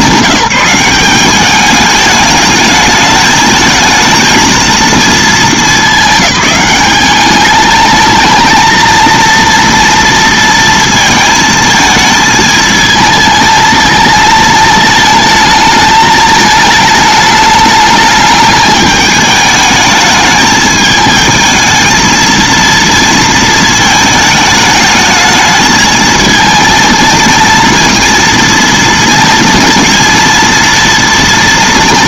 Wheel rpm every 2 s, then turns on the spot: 200, 210, 220, 190, 220, 230, 220, 220, 210, 210, 220, 230, 210, 230, 230, 230.
none